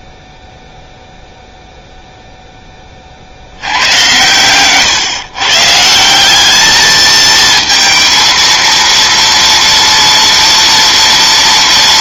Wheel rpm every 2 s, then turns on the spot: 0, 20, 120, 210, 230, 230.
4-6